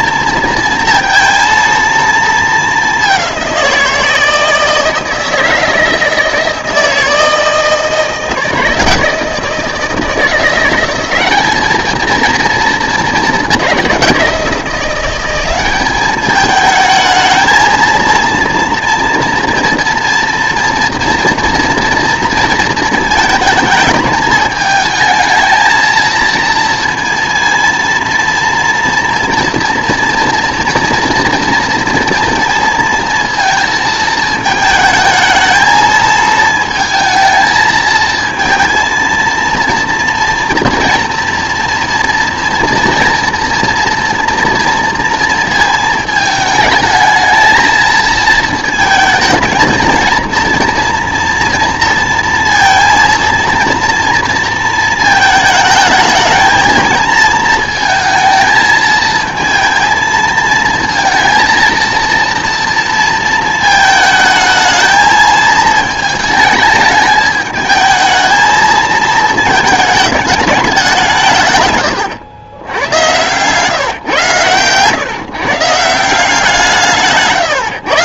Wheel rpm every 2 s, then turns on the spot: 230, 210, 160, 160, 160, 180, 220, 180, 220, 230, 230, 220, 220, 230, 230, 230, 230, 220, 220, 230, 230, 230, 230, 220, 220, 230, 230, 220, 220, 220, 220, 230, 220, 220, 220, 190, 120, 130, 170.
none